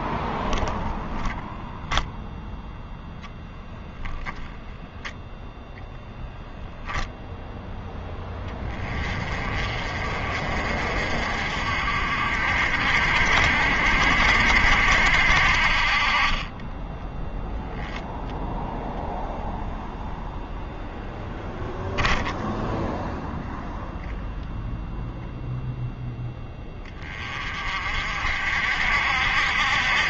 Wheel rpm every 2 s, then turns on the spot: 10, 0, 0, 0, 20, 50, 60, 60, 20, 0, 0, 0, 0, 10, 60.
0-2 16-18